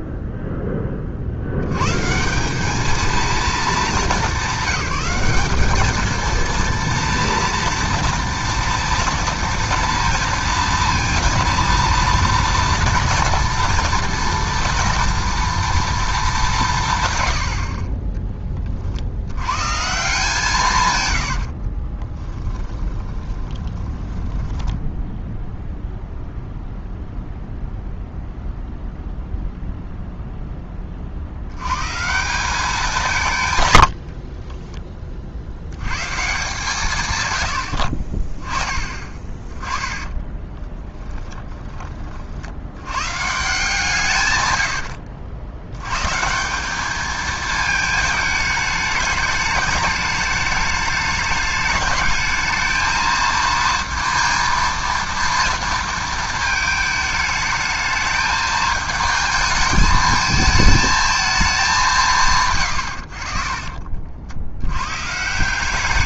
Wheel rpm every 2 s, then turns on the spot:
10, 200, 190, 230, 230, 230, 230, 230, 180, 40, 160, 20, 10, 0, 0, 10, 180, 20, 150, 30, 20, 80, 100, 190, 210, 210, 220, 230, 220, 220, 220, 120, 90.
22-26 34-36 40-42